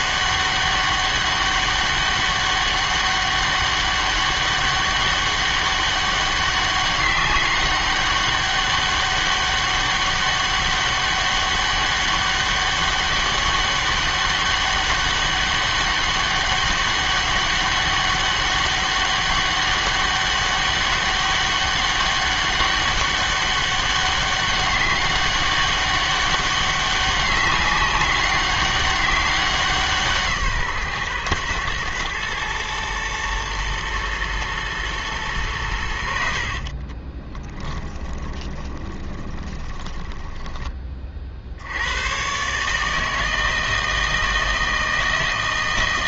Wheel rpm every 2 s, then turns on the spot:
200, 200, 200, 200, 200, 200, 200, 200, 200, 200, 200, 200, 200, 200, 200, 150, 110, 120, 50, 20, 20, 140, 160.
36-40